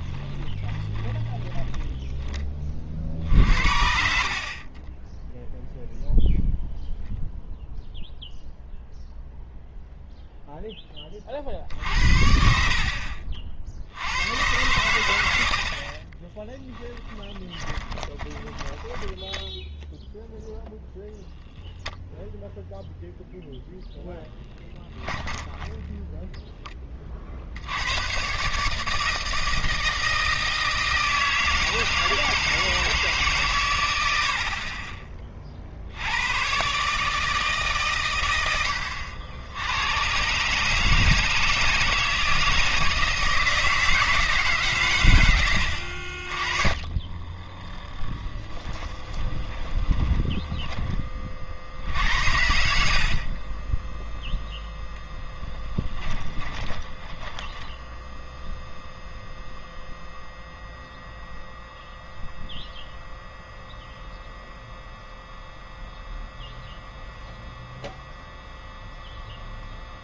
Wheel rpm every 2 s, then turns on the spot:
20, 30, 30, 0, 0, 10, 60, 110, 20, 10, 0, 0, 10, 10, 150, 160, 160, 40, 130, 80, 150, 160, 140, 30, 20, 10, 80, 0, 10, 0, 0, 0, 0, 0, 0.
0-2 4-6 16-20 24-26 46-52 56-58